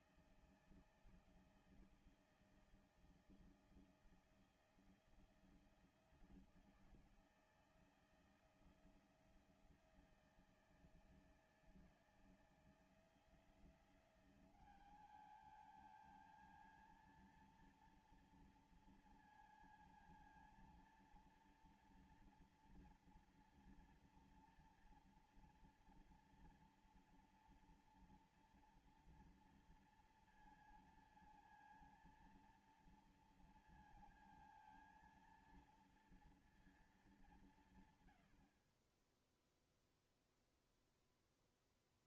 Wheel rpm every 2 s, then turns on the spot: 160, 160, 160, 160, 160, 160, 160, 190, 220, 230, 230, 230, 230, 230, 230, 230, 230, 230, 230, 100, 0.
none